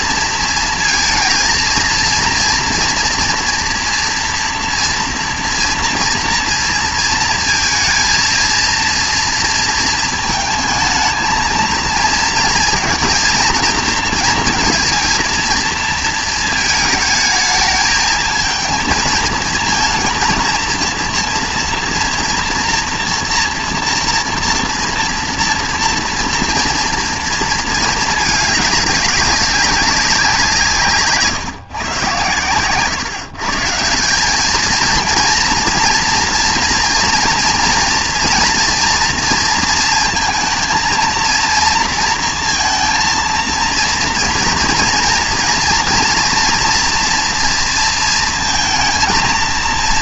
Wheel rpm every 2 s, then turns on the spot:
230, 230, 230, 230, 230, 220, 220, 230, 220, 220, 230, 230, 230, 230, 220, 160, 120, 220, 230, 230, 220, 230, 230, 240, 220.
none